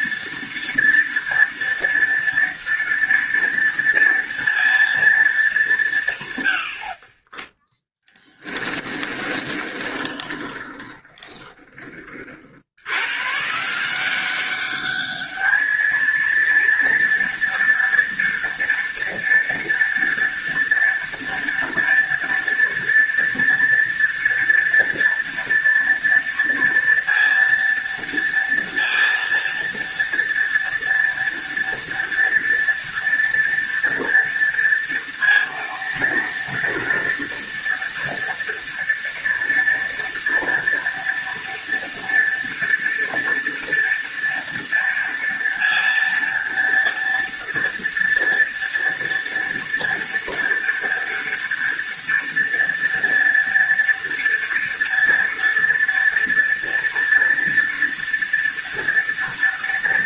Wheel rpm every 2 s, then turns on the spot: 230, 230, 230, 100, 20, 20, 60, 190, 230, 230, 230, 230, 230, 230, 230, 230, 230, 230, 230, 230, 230, 230, 230, 230, 230, 230, 230, 230, 230, 230.
8-12